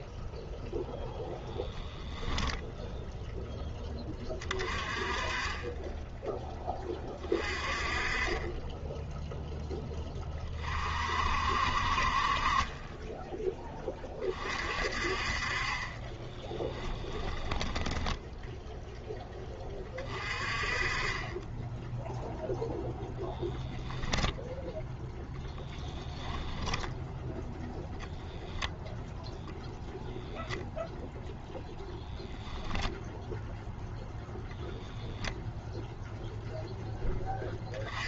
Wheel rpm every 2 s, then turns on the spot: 10, 10, 30, 20, 10, 40, 20, 40, 10, 0, 30, 0, 10, 10, 0, 0, 10, 0, 0.
16-18 26-28